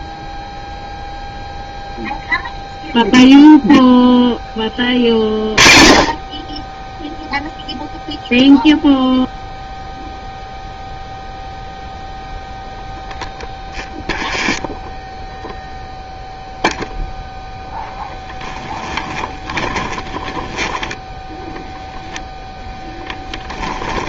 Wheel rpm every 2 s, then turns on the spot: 0, 0, 20, 20, 0, 0, 0, 0, 0, 10, 10, 0.
18-22